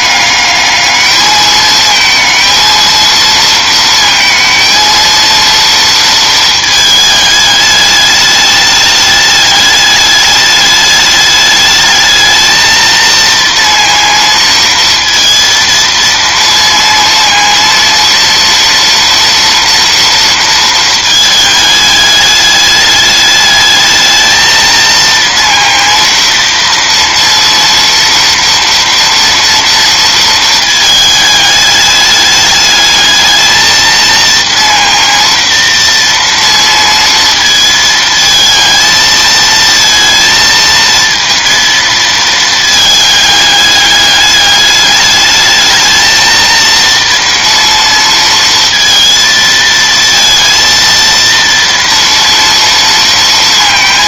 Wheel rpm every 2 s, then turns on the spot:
210, 220, 220, 220, 210, 210, 220, 230, 230, 230, 220, 210, 220, 230, 230, 220, 210, 230, 230, 220, 230, 220, 210, 230, 230, 230, 230.
none